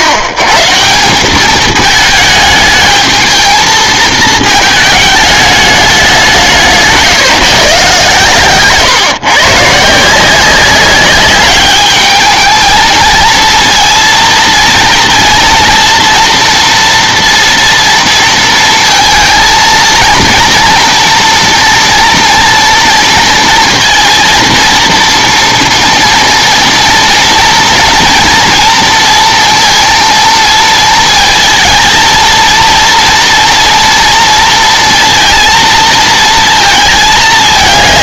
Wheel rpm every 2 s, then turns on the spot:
110, 220, 220, 170, 130, 180, 220, 230, 240, 230, 230, 230, 230, 230, 230, 230, 230, 230, 230.
none